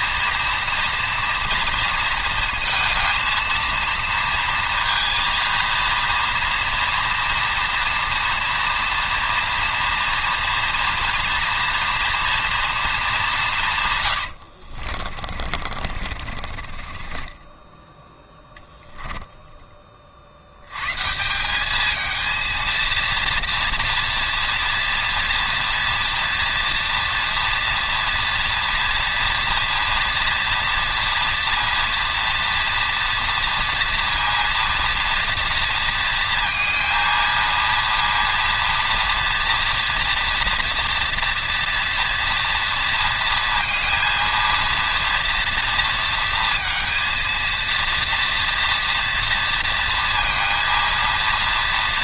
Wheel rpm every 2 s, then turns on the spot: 230, 220, 230, 230, 230, 240, 230, 60, 30, 0, 120, 230, 230, 230, 240, 240, 230, 230, 230, 230, 240, 230, 230, 230, 230, 230.
14-18